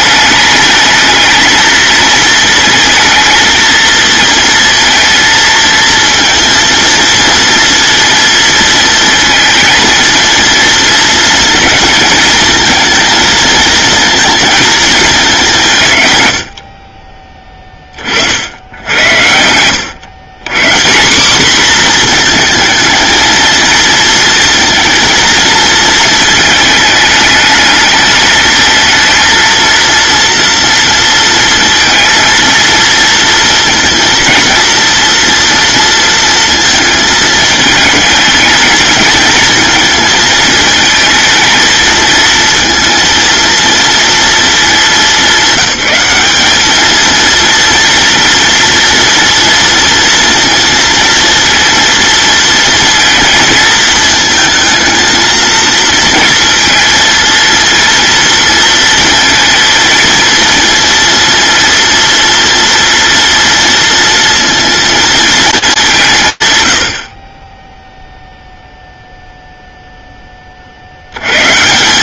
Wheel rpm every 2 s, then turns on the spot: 220, 220, 230, 230, 230, 220, 220, 220, 30, 80, 180, 220, 230, 210, 220, 230, 230, 230, 220, 220, 220, 230, 210, 220, 230, 230, 220, 220, 230, 230, 230, 230, 230, 90, 0, 70.
none